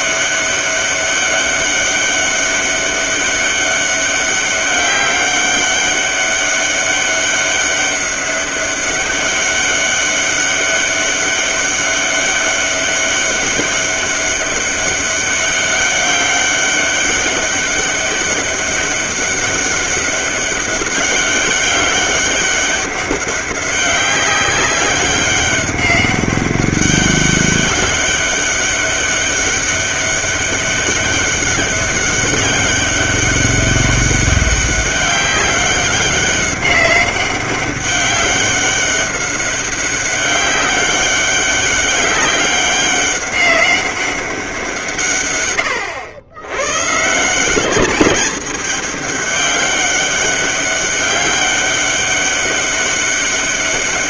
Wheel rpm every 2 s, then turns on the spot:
200, 200, 200, 200, 200, 200, 200, 200, 200, 200, 200, 190, 200, 200, 200, 200, 190, 190, 200, 200, 200, 200, 160, 120, 200, 200, 200.
none